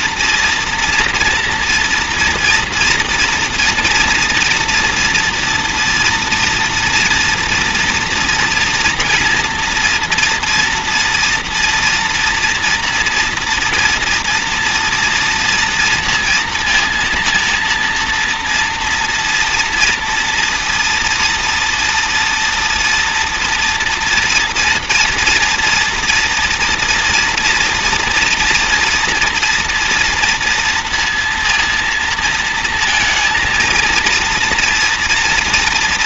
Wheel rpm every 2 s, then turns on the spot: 230, 230, 240, 230, 230, 230, 230, 230, 230, 240, 230, 230, 240, 240, 230, 230, 230, 230.
none